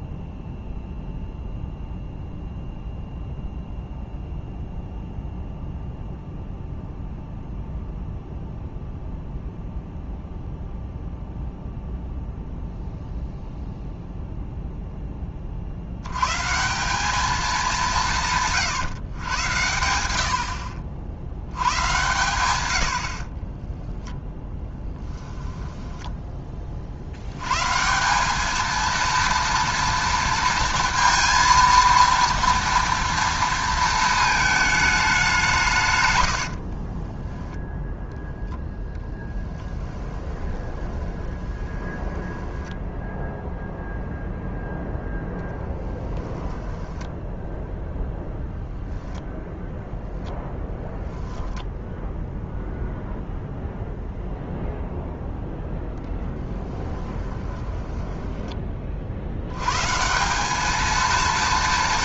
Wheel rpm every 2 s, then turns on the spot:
0, 0, 0, 0, 0, 0, 0, 0, 180, 120, 50, 90, 10, 40, 230, 230, 230, 210, 30, 10, 20, 10, 0, 10, 0, 10, 0, 0, 10, 40, 220.
36-38 40-44 46-48 56-58